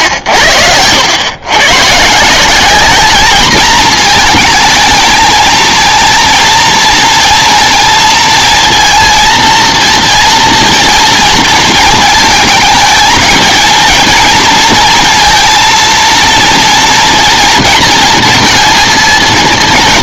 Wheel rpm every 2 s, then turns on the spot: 80, 190, 220, 230, 230, 230, 220, 230, 230, 230.
none